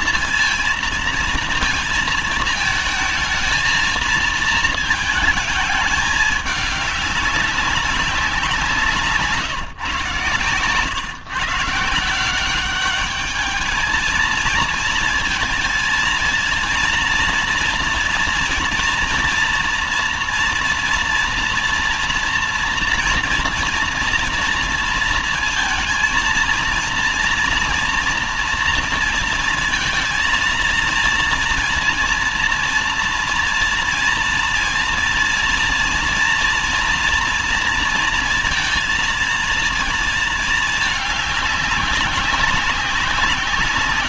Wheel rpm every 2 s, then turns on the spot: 230, 220, 220, 210, 180, 130, 190, 230, 230, 230, 230, 240, 230, 230, 230, 230, 230, 230, 230, 230, 210, 180.
none